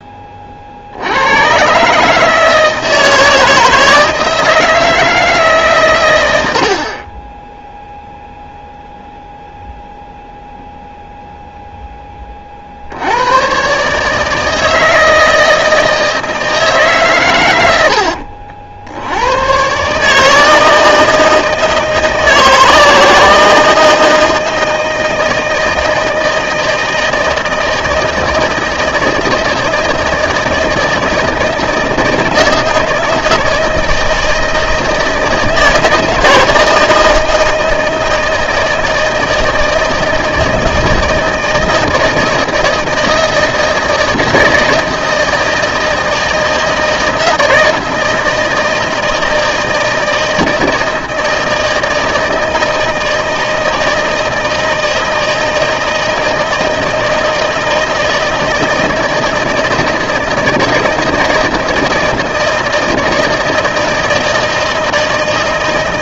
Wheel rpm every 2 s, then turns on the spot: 50, 160, 160, 50, 0, 0, 50, 160, 150, 70, 160, 160, 160, 160, 160, 160, 160, 160, 160, 160, 160, 160, 160, 160, 160, 160, 160, 160, 160, 160, 160, 160, 160.
none